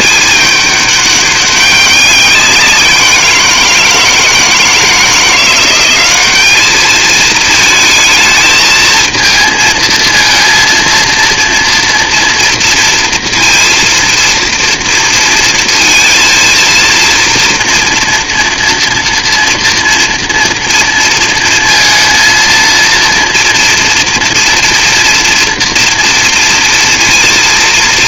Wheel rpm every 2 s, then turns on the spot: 210, 190, 160, 210, 220, 230, 230, 230, 230, 240, 230, 230, 240, 230.
none